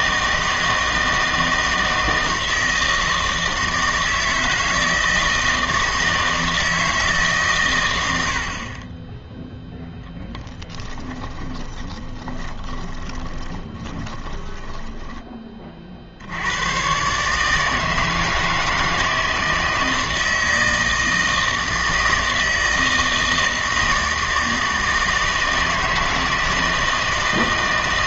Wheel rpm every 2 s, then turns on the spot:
160, 160, 160, 160, 30, 10, 20, 10, 110, 160, 160, 160, 160, 160.
10-16